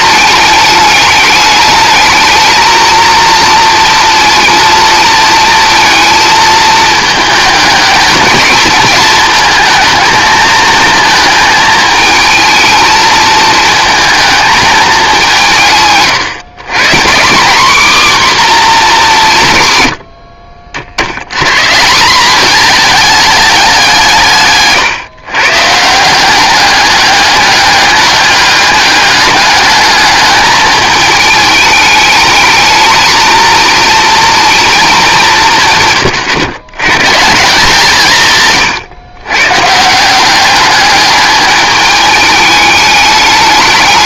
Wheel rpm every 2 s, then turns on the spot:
210, 230, 230, 220, 220, 220, 220, 220, 160, 230, 60, 220, 150, 200, 200, 210, 220, 220, 130, 140, 200, 210.
none